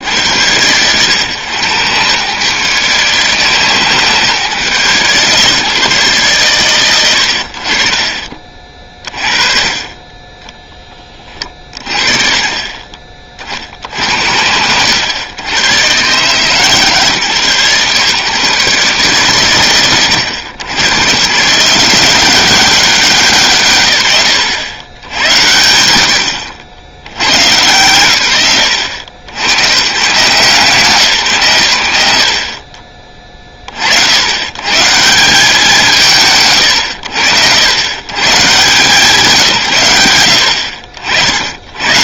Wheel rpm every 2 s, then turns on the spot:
100, 140, 140, 90, 40, 20, 30, 90, 150, 140, 110, 180, 100, 50, 100, 170, 30, 130, 100, 160, 70.
none